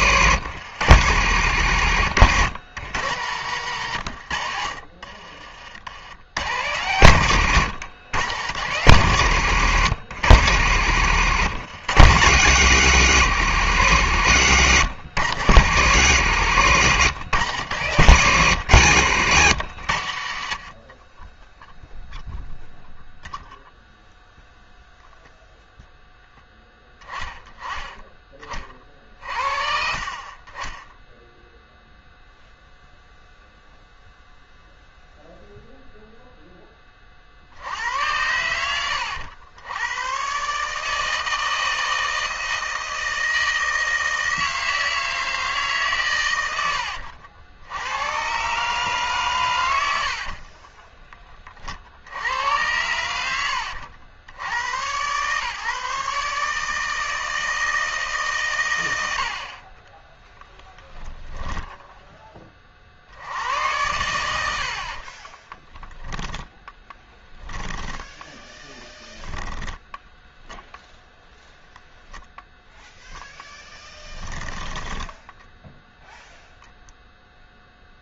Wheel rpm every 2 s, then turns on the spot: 60, 90, 60, 90, 80, 60, 90, 70, 80, 90, 60, 0, 0, 10, 40, 20, 0, 0, 20, 100, 140, 160, 160, 70, 140, 20, 90, 110, 150, 100, 10, 30, 60, 10, 10, 0, 0, 10, 0.
14-16 20-22 50-52 66-70 74-76